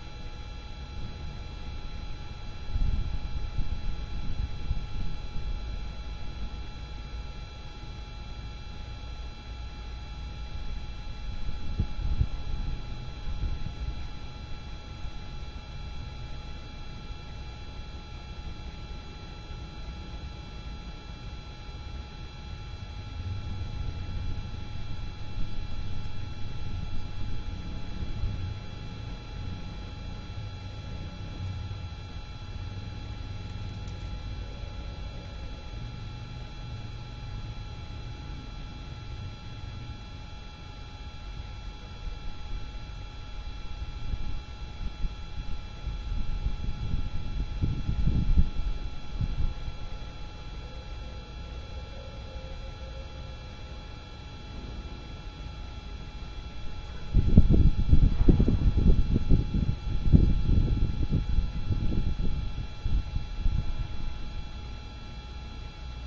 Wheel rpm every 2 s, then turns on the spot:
0, 0, 0, 0, 0, 0, 0, 0, 0, 0, 0, 0, 0, 0, 0, 0, 0, 0, 0, 0, 0, 0, 0, 0, 0, 0, 0, 0, 0, 0, 0, 0, 0.
none